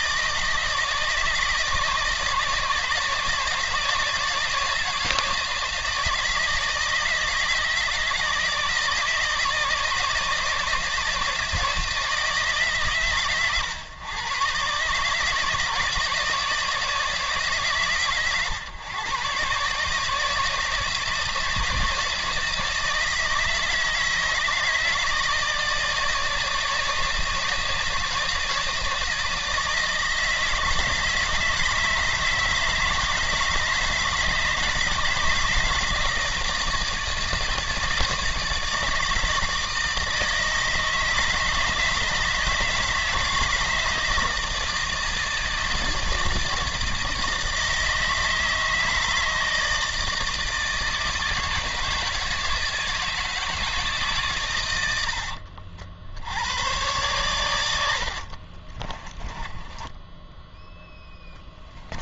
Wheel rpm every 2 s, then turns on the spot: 160, 160, 160, 160, 160, 150, 130, 140, 160, 130, 160, 160, 160, 160, 160, 160, 160, 160, 160, 160, 160, 160, 160, 160, 160, 160, 160, 110, 100, 40, 10.
58-60